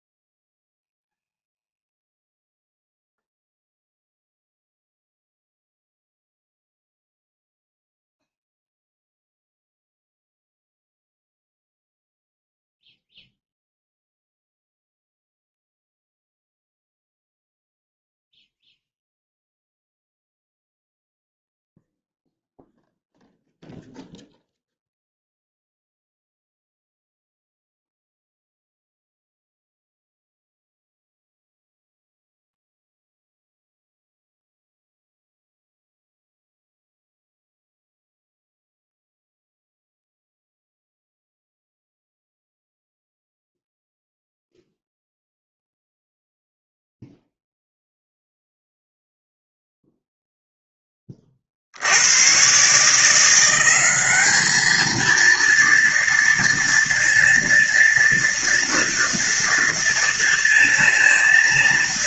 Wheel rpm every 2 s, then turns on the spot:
0, 0, 0, 0, 0, 0, 0, 0, 0, 0, 0, 0, 0, 0, 0, 0, 0, 0, 0, 0, 0, 0, 0, 0, 0, 0, 110, 210, 230, 230, 230.
none